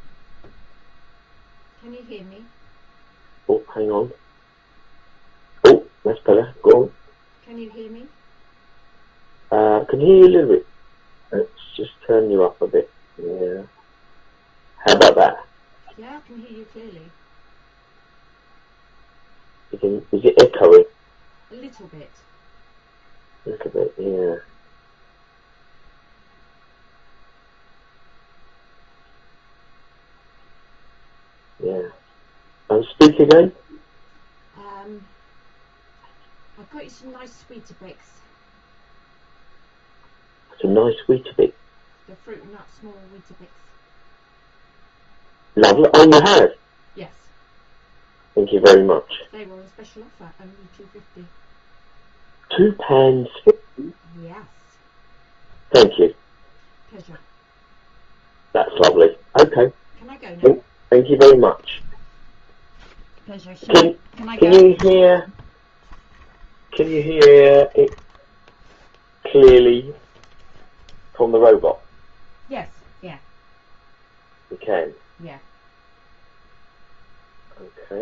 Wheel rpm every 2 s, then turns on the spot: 0, 0, 0, 0, 0, 0, 0, 0, 0, 0, 0, 0, 0, 0, 0, 0, 0, 0, 0, 0, 0, 0, 0, 0, 0, 0, 0, 0, 0, 0, 0, 0, 0, 0, 0, 0, 0, 0, 0.
none